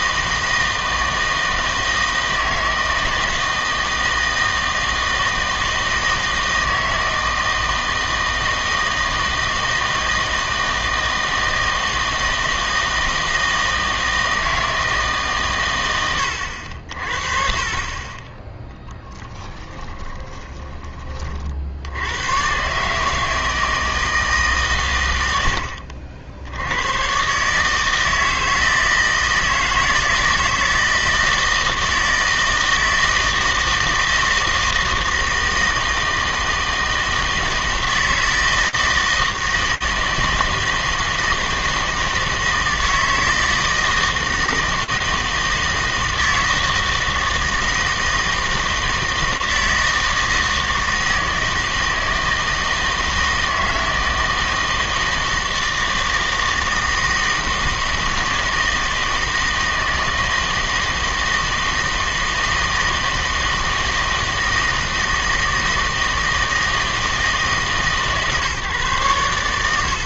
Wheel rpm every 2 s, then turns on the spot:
160, 160, 160, 160, 160, 160, 160, 160, 80, 10, 20, 130, 140, 90, 160, 160, 160, 160, 160, 160, 160, 160, 160, 160, 160, 160, 160, 160, 160, 160, 160, 160, 160, 160, 140.
none